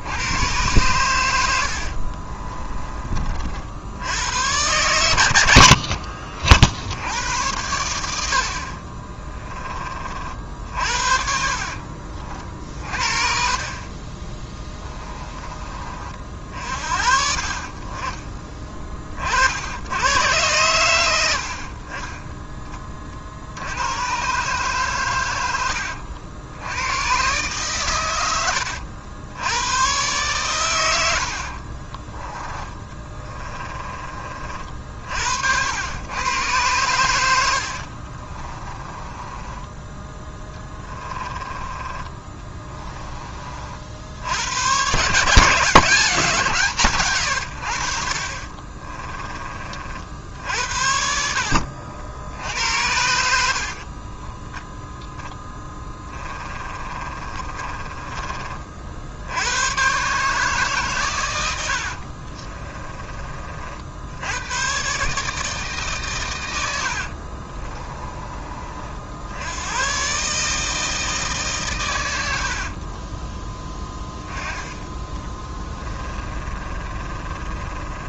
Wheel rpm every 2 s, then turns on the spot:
110, 30, 100, 70, 50, 60, 40, 20, 50, 30, 110, 30, 130, 100, 70, 100, 20, 50, 110, 20, 20, 20, 120, 140, 30, 70, 80, 10, 30, 50, 140, 30, 120, 80, 50, 160, 40, 20, 30.
2-4 8-12 14-16 32-34 38-42 48-52 56-58 62-64 66-68 72-74 76-78